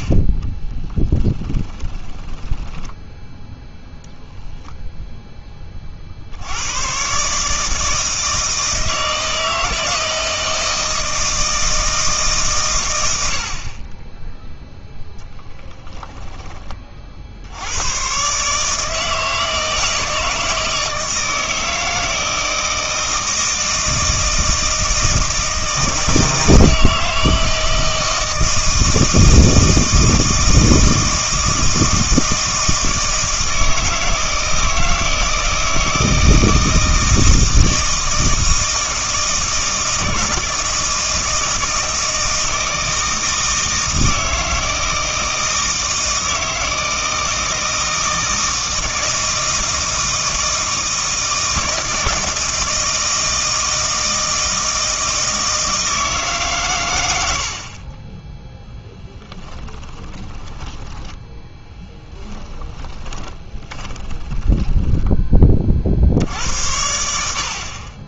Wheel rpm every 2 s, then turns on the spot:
10, 10, 0, 110, 160, 160, 130, 0, 40, 150, 160, 160, 160, 160, 160, 160, 160, 160, 160, 160, 160, 160, 160, 160, 160, 160, 160, 160, 120, 0, 10, 20, 10, 80.
0-4 60-66